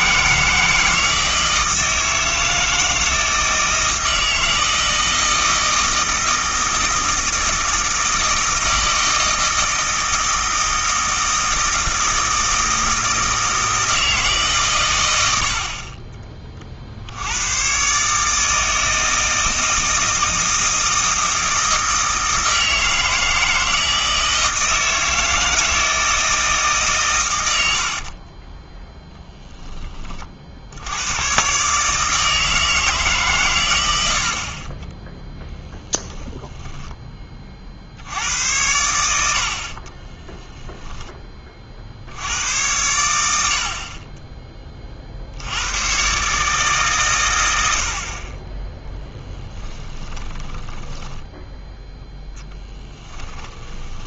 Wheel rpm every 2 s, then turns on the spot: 160, 160, 160, 160, 160, 160, 160, 130, 40, 160, 160, 160, 160, 140, 10, 70, 150, 30, 10, 90, 0, 100, 20, 140, 10, 10, 10.
28-30 34-36 50-54